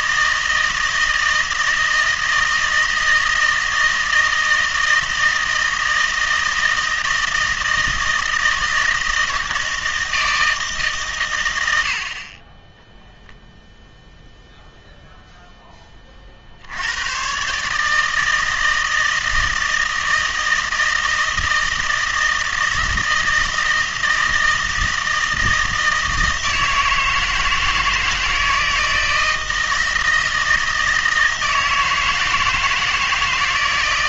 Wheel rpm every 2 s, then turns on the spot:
160, 160, 160, 160, 160, 160, 20, 0, 70, 160, 160, 160, 160, 160, 160, 160, 160.
none